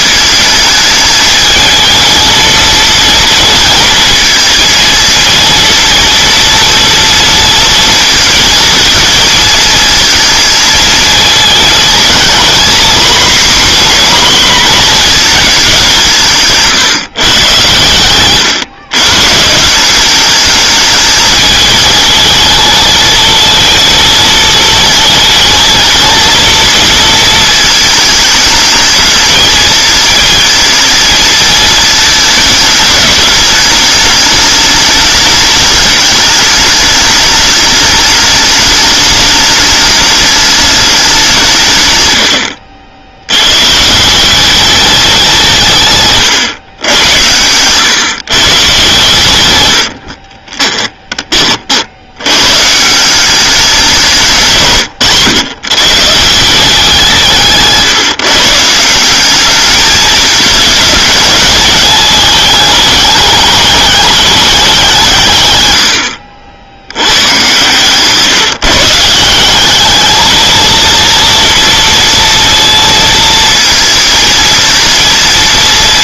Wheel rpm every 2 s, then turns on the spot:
220, 230, 230, 230, 230, 220, 240, 240, 150, 120, 210, 220, 230, 230, 210, 220, 210, 210, 210, 210, 210, 70, 200, 110, 130, 20, 150, 140, 180, 170, 220, 210, 190, 70, 150, 230, 230, 230.
50-52 54-56